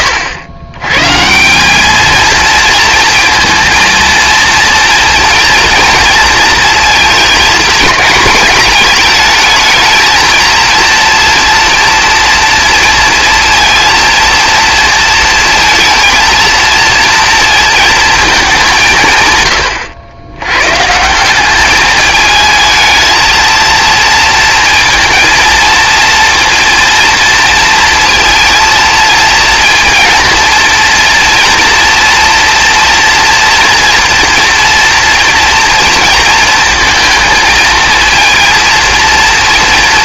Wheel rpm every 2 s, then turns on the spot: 110, 230, 230, 220, 210, 230, 230, 230, 230, 170, 130, 220, 230, 230, 230, 230, 240, 230, 220, 230.
none